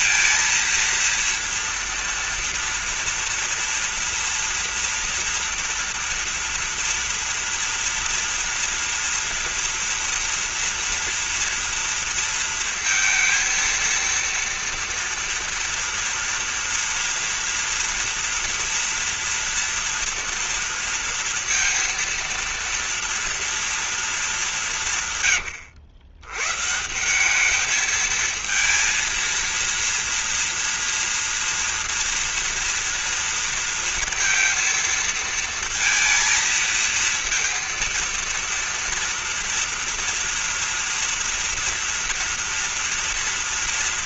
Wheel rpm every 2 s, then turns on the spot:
230, 230, 230, 230, 230, 230, 230, 240, 230, 230, 240, 230, 170, 150, 230, 230, 230, 230, 230, 230, 230, 230.
none